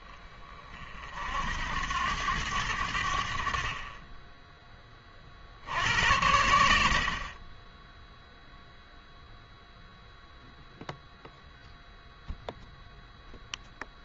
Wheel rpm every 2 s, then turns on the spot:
30, 100, 20, 80, 0, 0, 10.
none